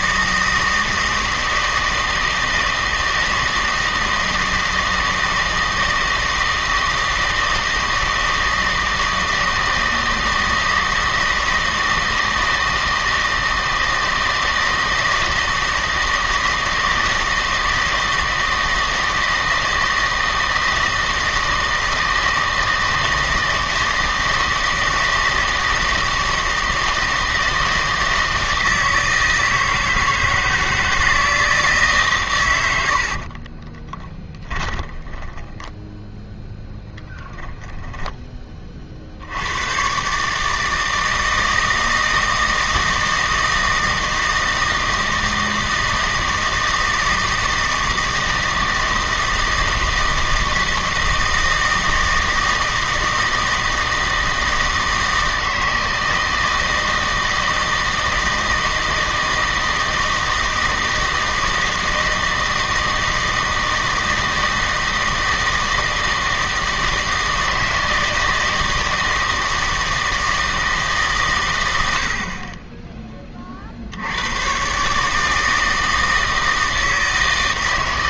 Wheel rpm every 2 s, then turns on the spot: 160, 160, 160, 160, 160, 160, 160, 160, 160, 160, 160, 160, 160, 160, 160, 160, 90, 20, 0, 30, 160, 160, 160, 160, 160, 160, 160, 160, 160, 160, 160, 160, 160, 160, 160, 150, 20, 130, 160.
34-36